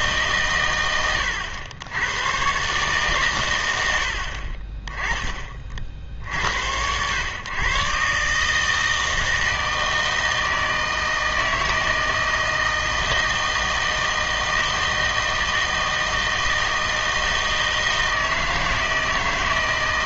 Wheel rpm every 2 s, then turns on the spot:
120, 130, 30, 90, 150, 160, 160, 160, 160, 160.
none